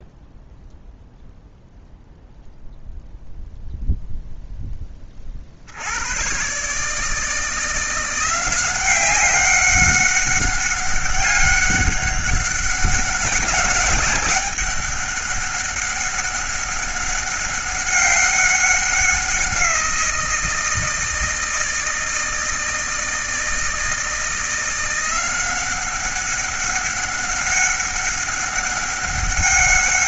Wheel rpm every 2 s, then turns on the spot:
0, 0, 20, 160, 190, 200, 190, 200, 190, 190, 160, 160, 170, 200, 190.
none